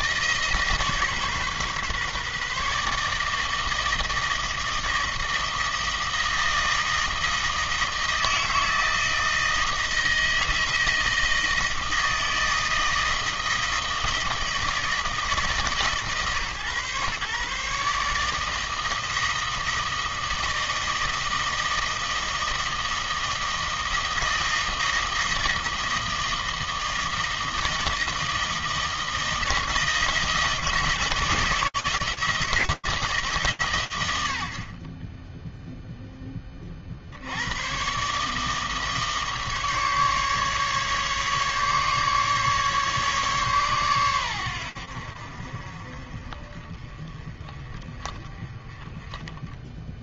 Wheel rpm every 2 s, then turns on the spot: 150, 140, 160, 160, 160, 160, 160, 160, 140, 160, 160, 160, 160, 160, 160, 160, 160, 30, 40, 150, 150, 140, 80, 30, 10.
none